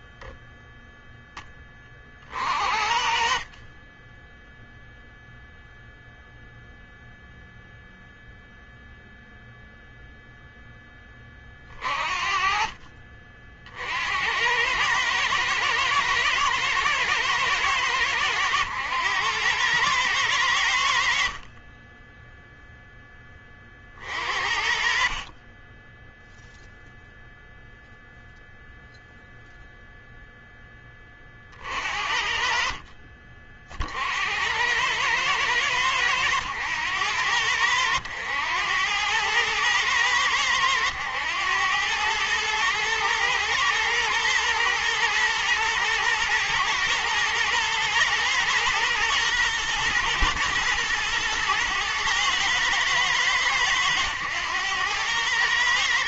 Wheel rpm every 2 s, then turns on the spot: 0, 50, 0, 0, 0, 10, 40, 100, 110, 100, 80, 0, 40, 0, 0, 10, 50, 90, 90, 90, 100, 110, 110, 120, 120, 110, 110, 100.
none